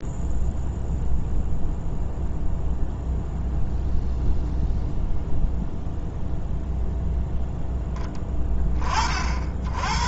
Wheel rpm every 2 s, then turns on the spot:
0, 0, 0, 0, 10.
none